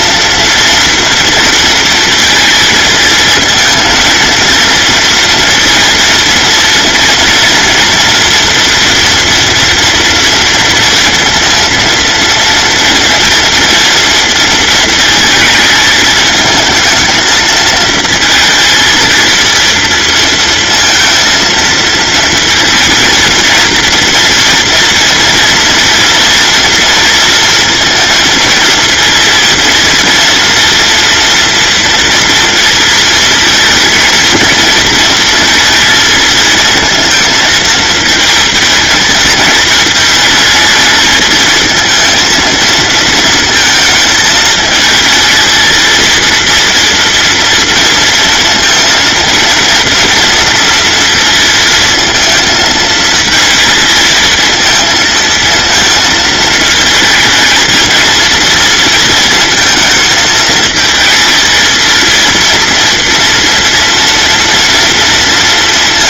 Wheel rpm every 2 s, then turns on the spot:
230, 230, 230, 230, 230, 230, 230, 230, 220, 230, 230, 230, 230, 230, 230, 230, 230, 230, 230, 220, 220, 230, 220, 230, 230, 230, 220, 220, 220, 230, 220, 230, 230.
none